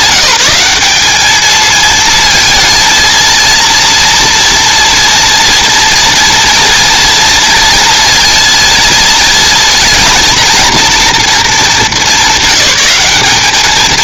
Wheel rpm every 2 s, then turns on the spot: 190, 230, 230, 230, 230, 240, 200.
none